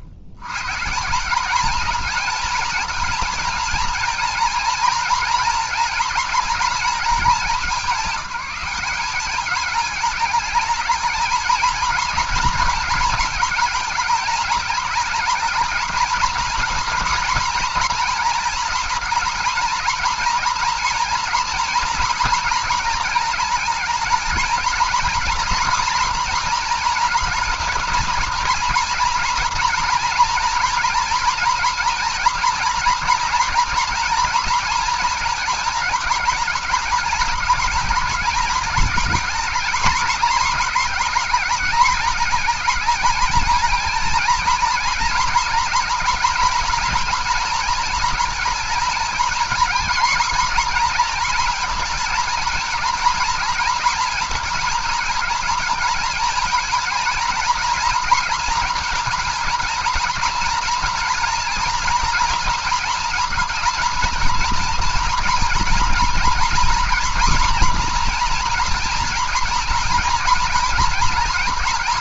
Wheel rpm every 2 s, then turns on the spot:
110, 220, 230, 230, 200, 210, 220, 220, 230, 230, 230, 230, 220, 240, 230, 230, 220, 230, 210, 220, 230, 210, 220, 230, 230, 230, 230, 220, 230, 230, 230, 240, 230, 240, 240, 230.
none